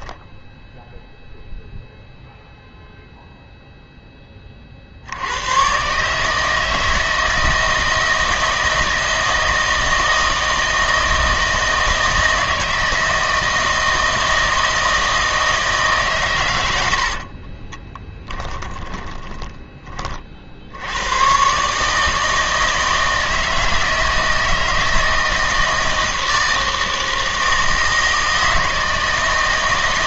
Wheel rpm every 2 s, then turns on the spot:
0, 0, 40, 160, 160, 160, 160, 160, 100, 10, 70, 160, 160, 160, 160.
18-20